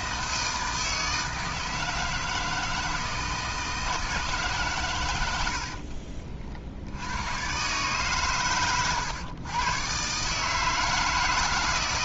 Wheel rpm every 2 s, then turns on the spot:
160, 160, 130, 60, 120, 160.
none